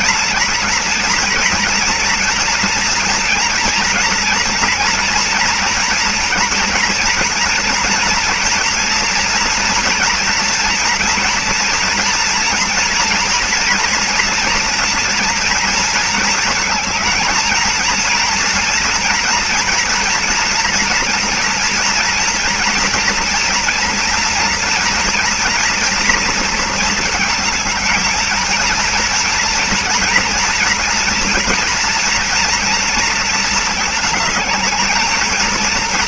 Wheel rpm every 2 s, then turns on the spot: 240, 230, 230, 230, 230, 240, 240, 230, 220, 230, 240, 240, 230, 230, 230, 230, 230, 220.
none